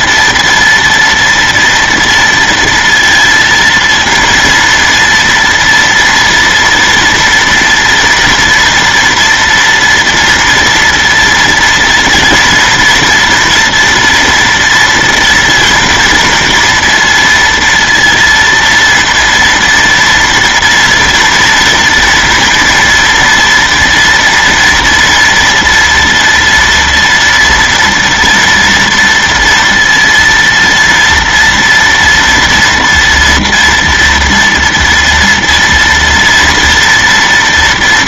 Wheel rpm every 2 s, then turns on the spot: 230, 230, 230, 230, 230, 230, 230, 230, 230, 230, 230, 230, 230, 230, 230, 230, 230, 240, 230.
none